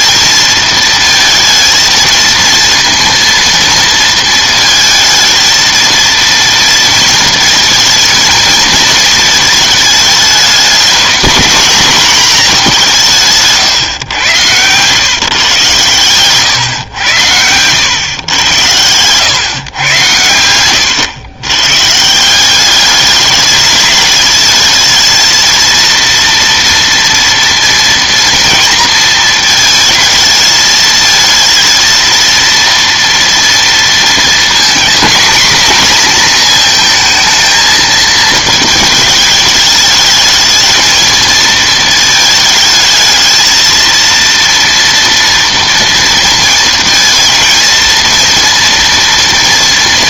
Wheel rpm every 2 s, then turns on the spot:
220, 230, 220, 230, 220, 210, 200, 110, 130, 100, 100, 200, 220, 230, 230, 220, 230, 240, 230, 220, 220, 220, 230, 230, 230.
18-20